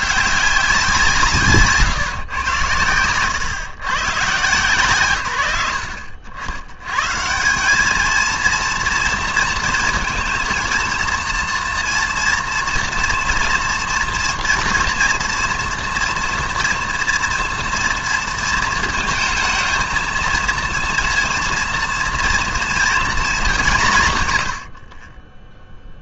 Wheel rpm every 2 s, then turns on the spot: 190, 110, 110, 100, 230, 230, 230, 230, 240, 230, 230, 230, 90.
24-26